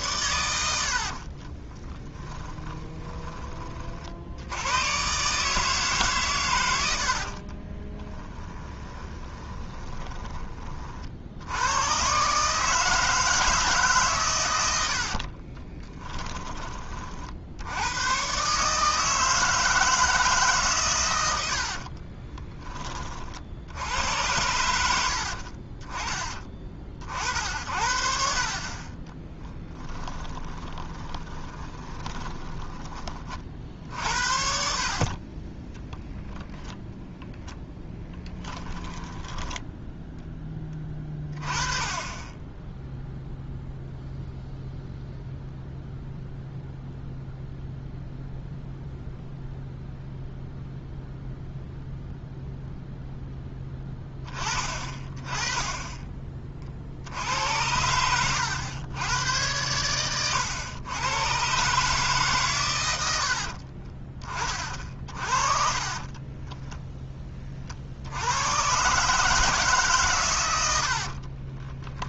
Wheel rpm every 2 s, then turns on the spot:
80, 10, 110, 100, 10, 30, 150, 100, 30, 150, 130, 20, 90, 50, 30, 20, 20, 50, 10, 10, 20, 10, 0, 0, 0, 0, 0, 30, 50, 100, 110, 120, 30, 10, 120, 100.
2-4 8-10 30-34 38-40 66-68 70-72